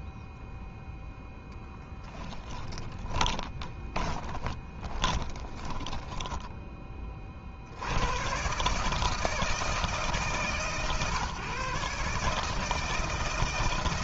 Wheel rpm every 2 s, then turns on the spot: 0, 20, 20, 10, 130, 150, 150.
2-6